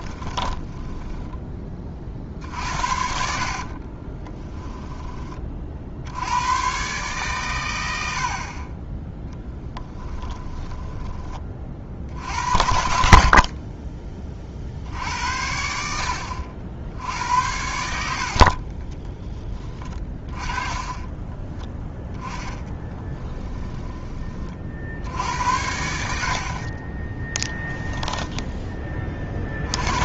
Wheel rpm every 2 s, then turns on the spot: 10, 60, 10, 130, 30, 20, 70, 70, 70, 20, 20, 10, 60, 30, 20.
0-4 10-12 18-20 22-24 26-28